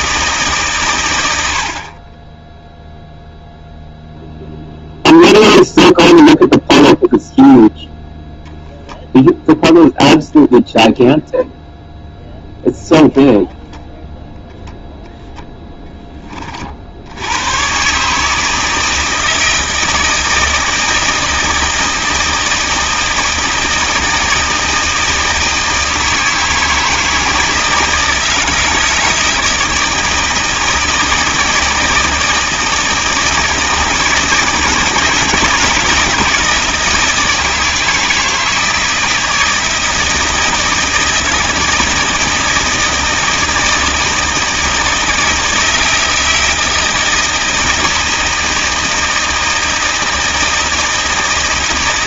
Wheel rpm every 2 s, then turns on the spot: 140, 0, 0, 0, 0, 0, 0, 0, 40, 160, 160, 160, 160, 160, 160, 160, 160, 160, 160, 160, 160, 160, 160, 160, 160, 160.
none